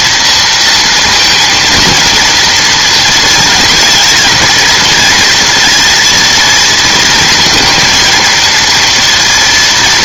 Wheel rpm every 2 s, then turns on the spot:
230, 230, 230, 230, 230.
none